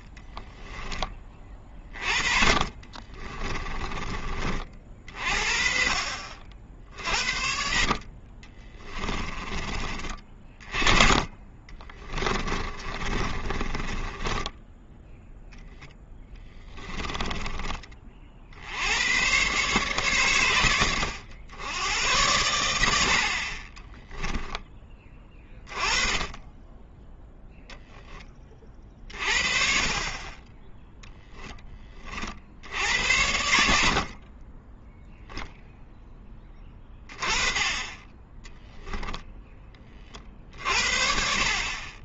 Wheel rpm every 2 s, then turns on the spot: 10, 40, 40, 50, 20, 30, 30, 10, 20, 80, 100, 80, 20, 10, 30, 10, 80, 10, 20, 0, 50.
2-4 8-10 12-14 16-18